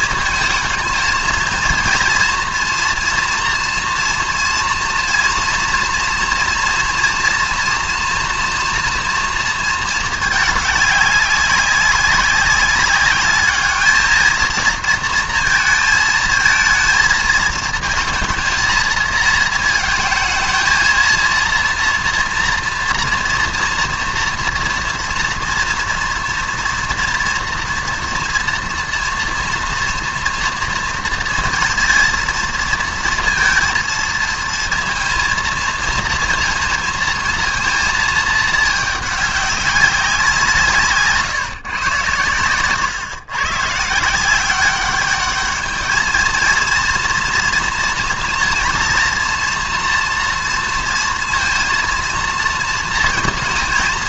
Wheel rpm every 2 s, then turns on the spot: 230, 240, 230, 230, 240, 210, 200, 230, 220, 230, 220, 230, 230, 230, 230, 240, 230, 230, 230, 220, 180, 110, 190, 230, 230, 230, 230.
none